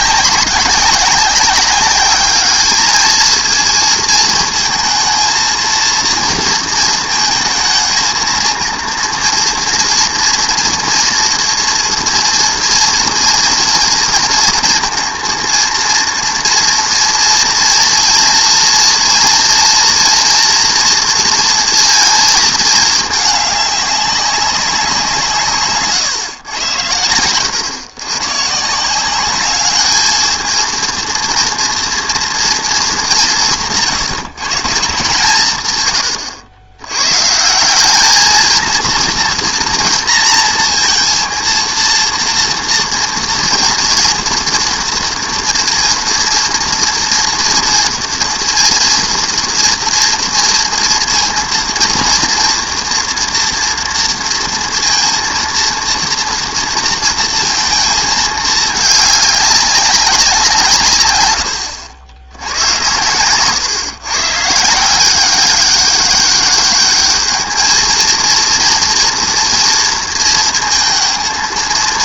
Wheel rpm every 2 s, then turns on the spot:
190, 210, 220, 230, 230, 240, 230, 230, 230, 230, 230, 220, 180, 100, 160, 230, 220, 160, 100, 230, 230, 230, 230, 240, 230, 230, 230, 230, 230, 210, 180, 90, 160, 210, 230, 230.
none